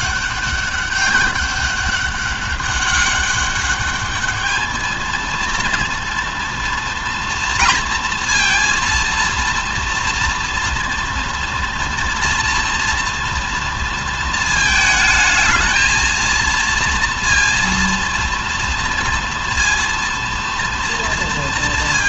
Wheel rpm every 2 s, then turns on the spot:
200, 200, 220, 230, 230, 230, 230, 220, 230, 230, 230.
none